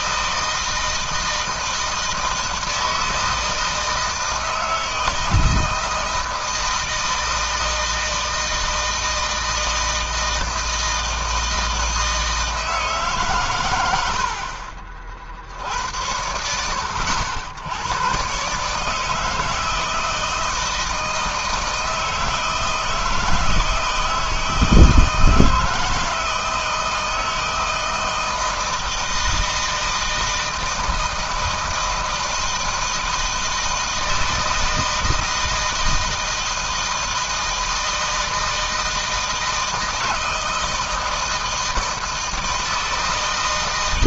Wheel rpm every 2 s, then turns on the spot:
160, 160, 160, 170, 160, 160, 160, 60, 90, 130, 160, 160, 160, 160, 160, 160, 160, 160, 160, 160, 160, 160.
none